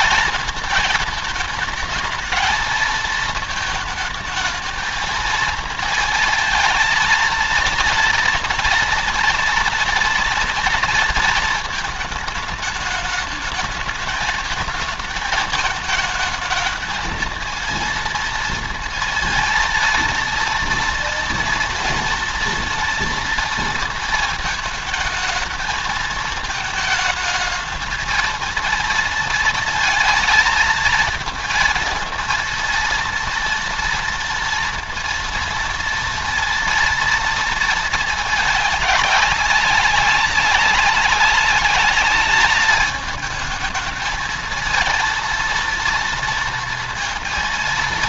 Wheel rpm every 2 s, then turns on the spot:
220, 220, 220, 220, 230, 240, 210, 220, 220, 230, 230, 230, 220, 220, 230, 220, 230, 230, 230, 210, 200, 210, 220, 230.
none